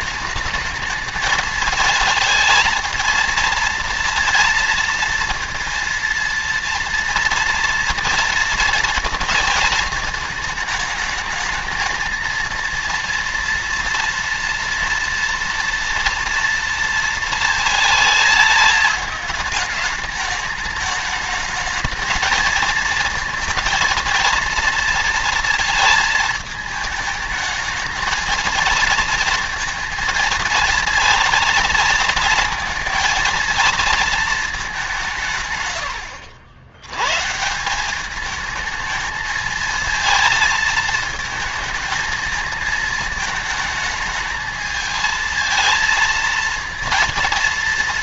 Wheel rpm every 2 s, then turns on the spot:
210, 220, 230, 240, 230, 210, 230, 240, 230, 210, 210, 220, 230, 220, 230, 230, 230, 190, 110, 220, 220, 220, 220, 230.
none